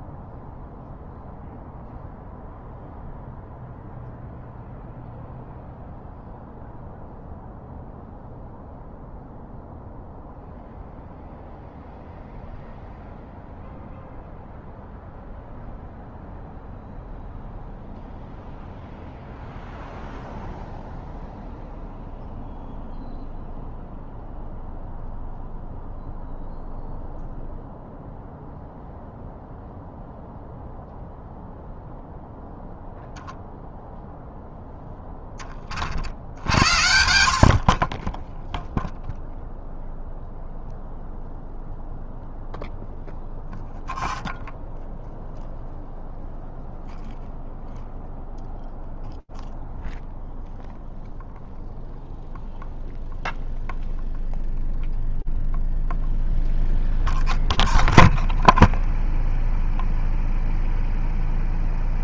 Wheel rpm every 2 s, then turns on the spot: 0, 0, 0, 0, 0, 0, 0, 0, 0, 0, 0, 0, 0, 0, 0, 0, 0, 0, 70, 0, 0, 0, 0, 0, 0, 0, 0, 0, 0, 0, 0.
none